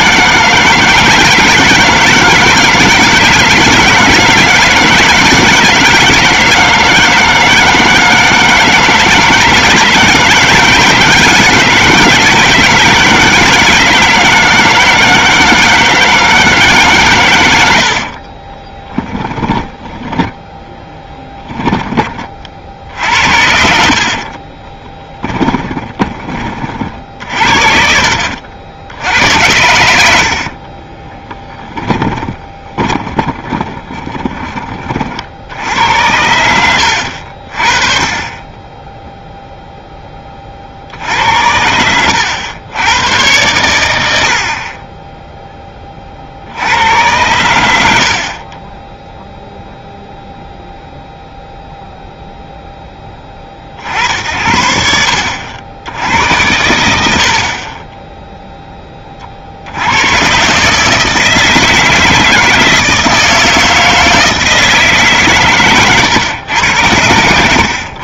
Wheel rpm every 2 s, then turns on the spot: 160, 160, 160, 160, 160, 160, 160, 160, 140, 20, 0, 50, 10, 50, 80, 30, 20, 20, 80, 10, 60, 100, 40, 90, 10, 0, 10, 70, 100, 10, 150, 160, 160, 90.
18-20 24-26 30-34 36-38